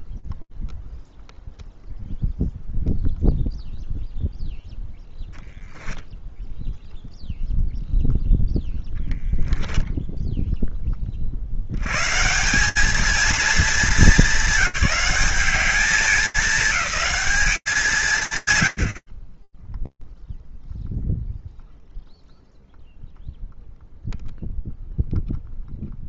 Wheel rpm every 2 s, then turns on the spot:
0, 0, 0, 0, 0, 10, 170, 210, 210, 110, 0, 0, 0.
none